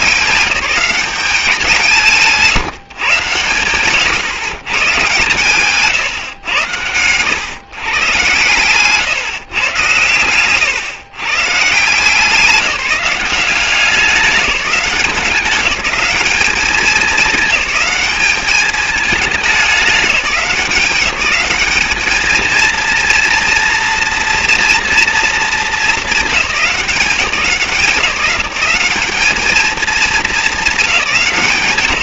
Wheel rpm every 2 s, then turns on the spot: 180, 150, 140, 120, 140, 130, 180, 200, 210, 210, 190, 220, 240, 210, 180, 210.
none